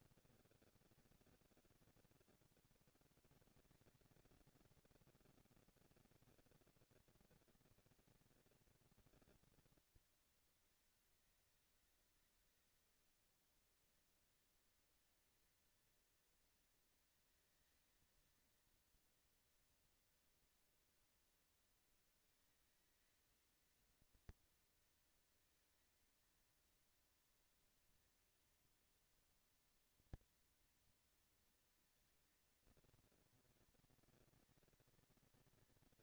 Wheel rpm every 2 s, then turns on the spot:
230, 230, 230, 230, 220, 200, 200, 220, 230, 220, 230, 230, 230, 230, 230, 230, 220, 230.
none